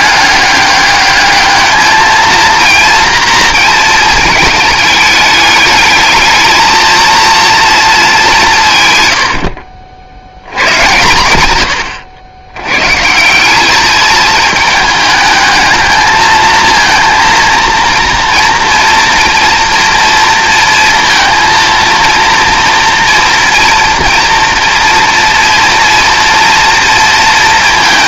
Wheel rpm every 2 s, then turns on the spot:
200, 230, 210, 230, 130, 120, 120, 220, 230, 230, 230, 230, 230, 230.
none